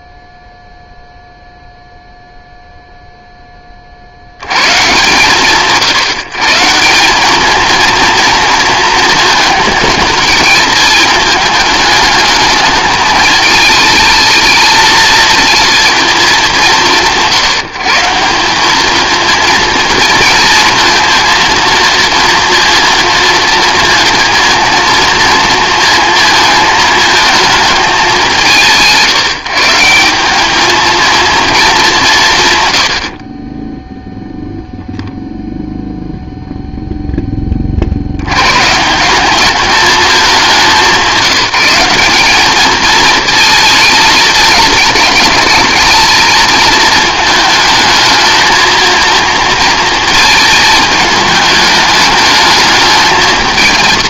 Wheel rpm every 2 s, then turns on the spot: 0, 0, 130, 160, 230, 220, 220, 220, 160, 200, 230, 230, 230, 220, 140, 220, 100, 0, 0, 140, 180, 220, 210, 220, 230, 220, 210.
none